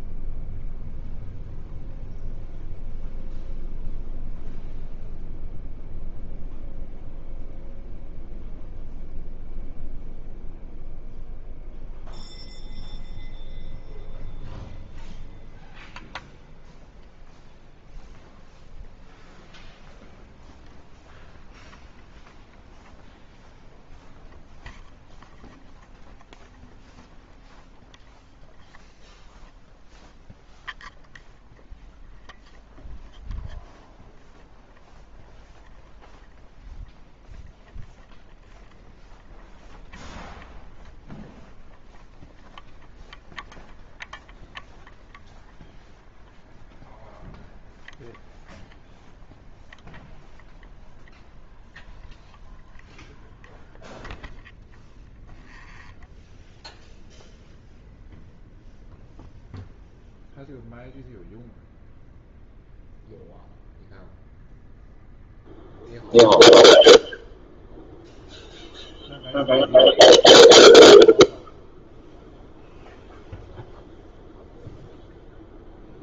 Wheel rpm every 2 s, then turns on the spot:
0, 0, 0, 0, 0, 0, 0, 0, 0, 0, 0, 0, 0, 0, 0, 0, 0, 0, 0, 0, 0, 0, 0, 0, 0, 0, 0, 0, 0, 0, 0, 0, 0, 0, 0, 0, 0, 0.
none